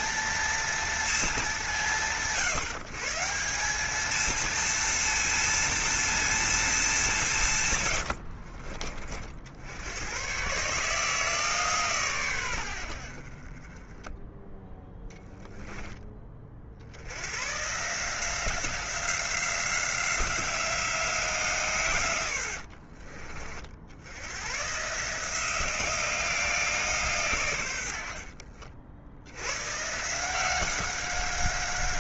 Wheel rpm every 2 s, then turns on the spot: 230, 150, 230, 210, 50, 150, 80, 10, 70, 180, 180, 60, 140, 150, 60, 190.
14-16 22-24